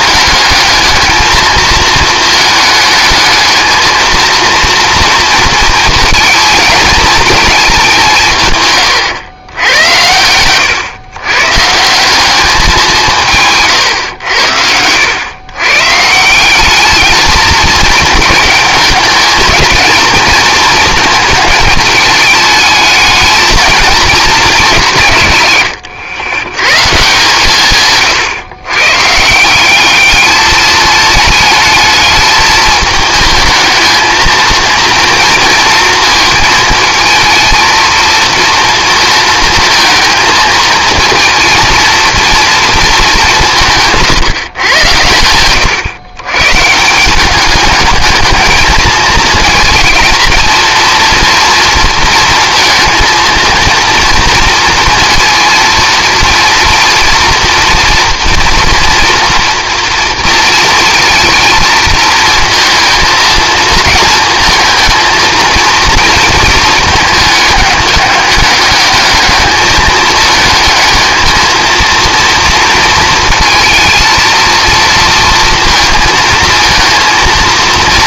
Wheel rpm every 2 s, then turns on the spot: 220, 220, 230, 220, 120, 120, 190, 90, 200, 210, 220, 220, 160, 150, 130, 210, 220, 230, 220, 230, 220, 220, 110, 170, 220, 230, 230, 230, 230, 230, 230, 220, 220, 220, 210, 220, 230, 230, 230.
none